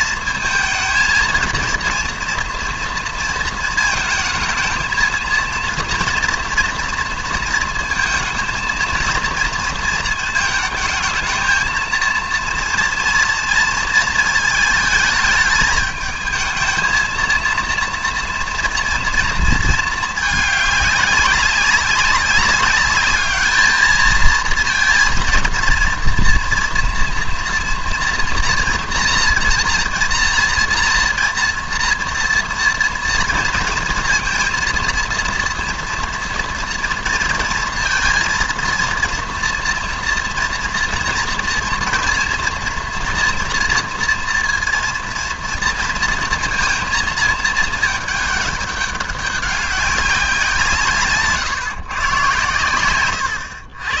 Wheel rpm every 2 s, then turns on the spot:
230, 230, 230, 230, 220, 220, 230, 220, 220, 240, 200, 200, 230, 230, 230, 230, 230, 230, 230, 230, 230, 230, 230, 230, 200, 180, 120.
none